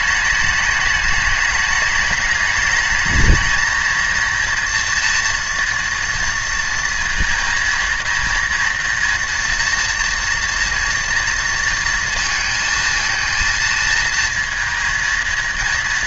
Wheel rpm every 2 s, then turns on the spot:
210, 210, 230, 230, 230, 230, 230, 230.
none